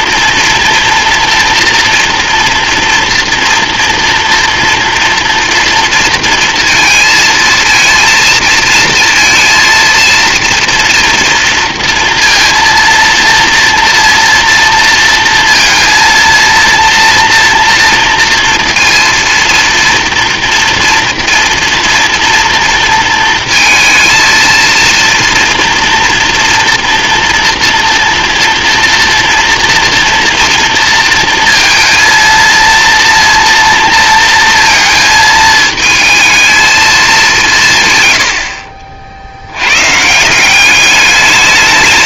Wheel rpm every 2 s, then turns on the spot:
230, 230, 230, 230, 230, 230, 230, 230, 230, 240, 230, 230, 230, 230, 230, 230, 230, 230, 220, 60, 190.
none